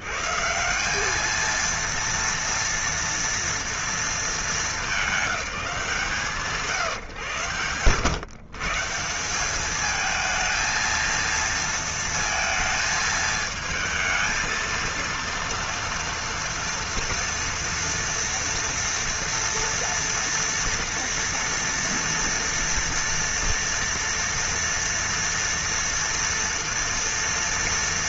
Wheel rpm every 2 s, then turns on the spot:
160, 230, 210, 150, 130, 220, 220, 230, 230, 230, 230, 230, 230, 230.
none